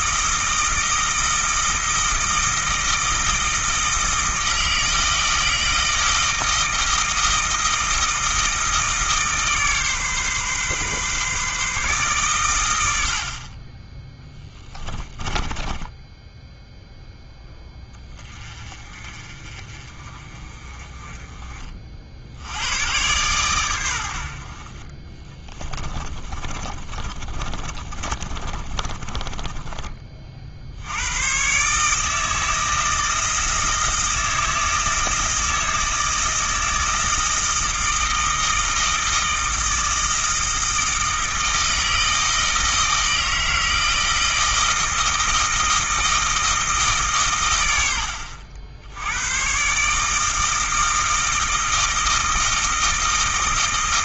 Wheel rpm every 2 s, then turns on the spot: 160, 160, 160, 160, 160, 140, 100, 10, 0, 30, 30, 100, 50, 20, 30, 70, 160, 160, 160, 160, 160, 160, 160, 160, 70, 160, 160.
14-16 24-30